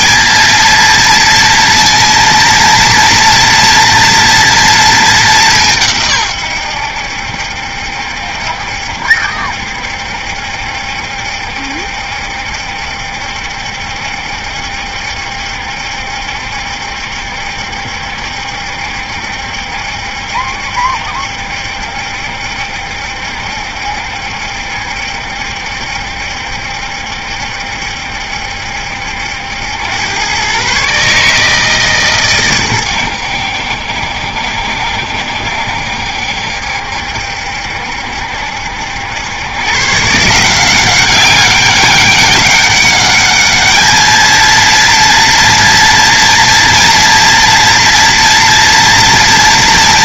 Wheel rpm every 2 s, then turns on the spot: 230, 230, 230, 110, 70, 70, 70, 70, 70, 70, 70, 70, 70, 70, 70, 120, 120, 70, 70, 80, 180, 200, 230, 230, 230.
none